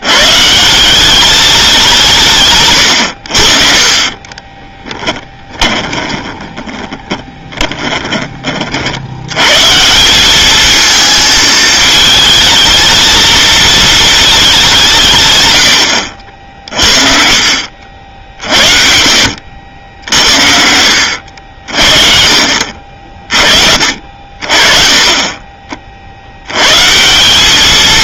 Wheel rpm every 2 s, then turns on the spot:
190, 90, 10, 20, 70, 220, 220, 180, 50, 50, 70, 50, 40, 90.
2-8